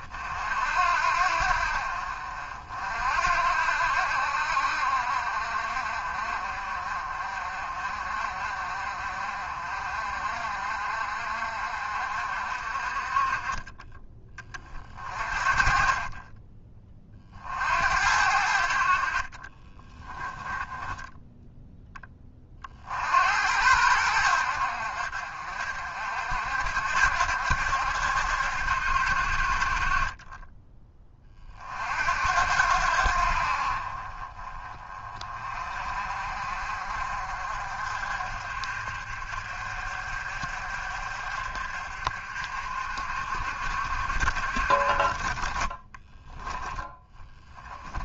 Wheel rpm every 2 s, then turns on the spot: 60, 60, 60, 50, 50, 50, 40, 40, 30, 50, 10, 60, 60, 70, 60, 20, 70, 30, 50, 50, 50, 50, 40, 10.
20-22